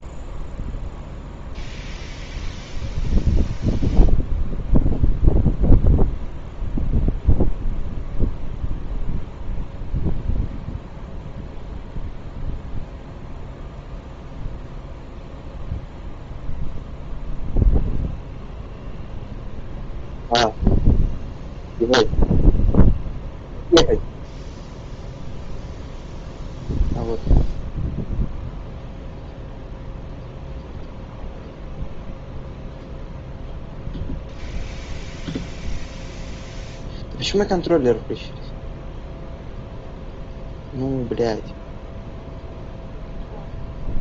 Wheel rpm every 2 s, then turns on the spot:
0, 0, 0, 0, 0, 0, 0, 0, 0, 0, 0, 0, 0, 0, 0, 0, 0, 0, 0, 0, 0, 0.
none